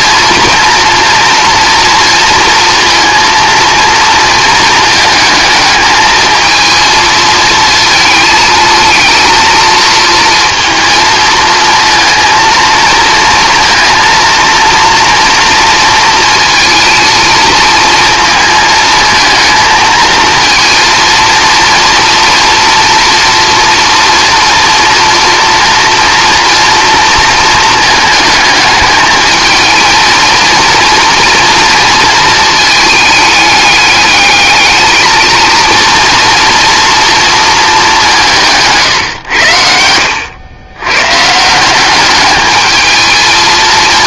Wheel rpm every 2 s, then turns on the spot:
240, 230, 220, 220, 220, 230, 230, 240, 230, 220, 230, 230, 230, 230, 220, 240, 220, 220, 230, 140, 110, 220.
none